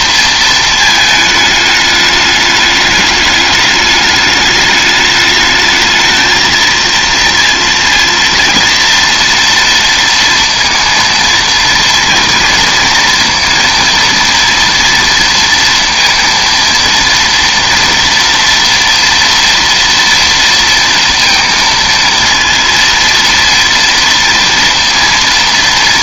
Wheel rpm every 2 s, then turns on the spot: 220, 210, 210, 230, 230, 230, 230, 230, 230, 230, 230, 230, 230.
none